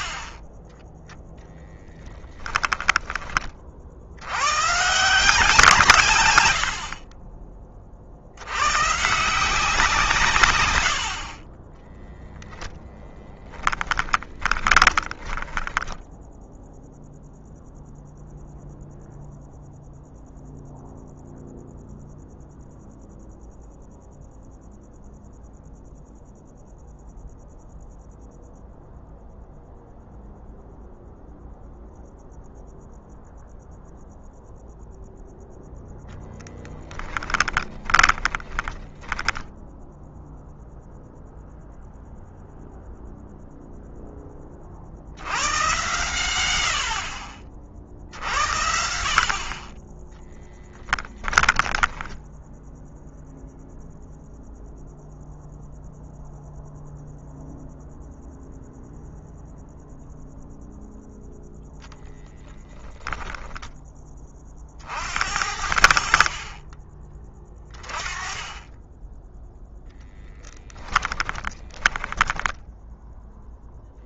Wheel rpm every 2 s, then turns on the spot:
10, 20, 130, 50, 120, 110, 0, 10, 0, 0, 0, 0, 0, 0, 0, 0, 0, 0, 10, 20, 0, 0, 70, 70, 70, 20, 0, 0, 0, 0, 0, 10, 60, 20, 10, 10, 10.
0-2 14-16 36-40 50-52 70-72